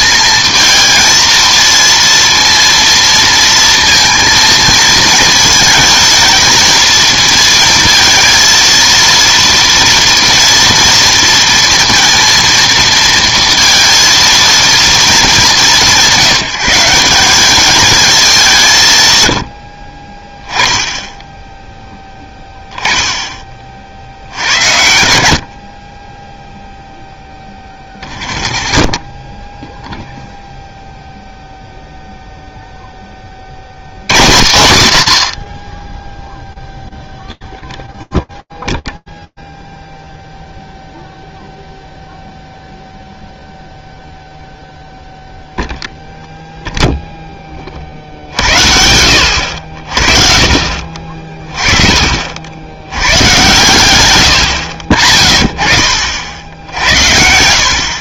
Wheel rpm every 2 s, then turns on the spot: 230, 230, 230, 220, 230, 230, 230, 230, 170, 180, 10, 10, 80, 0, 0, 0, 0, 100, 0, 0, 0, 0, 0, 0, 80, 40, 110, 40, 80.
none